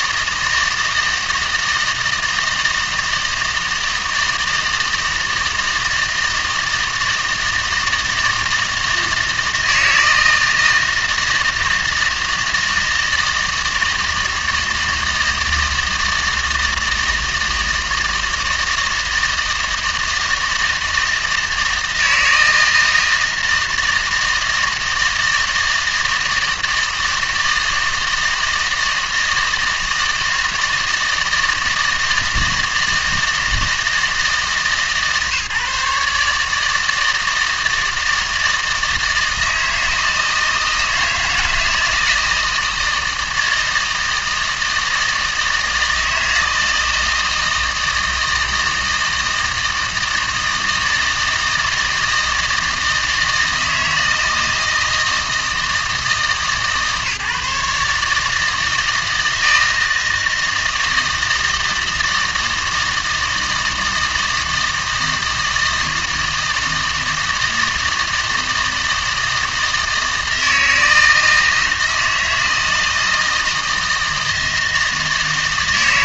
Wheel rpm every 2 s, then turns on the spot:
160, 160, 160, 160, 160, 160, 160, 160, 160, 160, 160, 160, 160, 160, 160, 160, 160, 150, 160, 160, 160, 160, 160, 160, 160, 160, 160, 160, 150, 160, 160, 160, 160, 160, 160, 160, 160, 160.
none